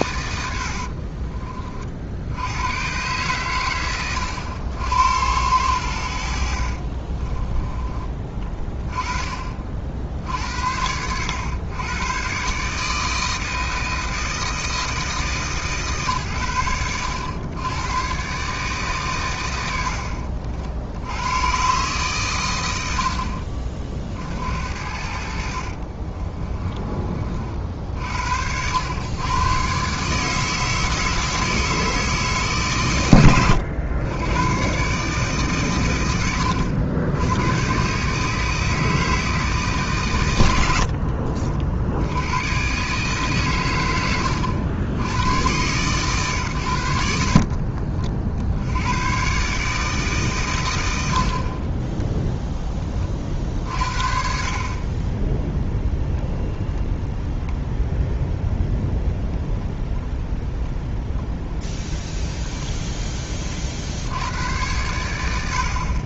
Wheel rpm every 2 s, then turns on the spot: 70, 100, 90, 50, 30, 70, 150, 160, 100, 140, 50, 100, 60, 20, 100, 160, 140, 130, 90, 160, 60, 130, 110, 100, 80, 100, 30, 30, 0, 0, 0, 10, 90.
0-2 26-28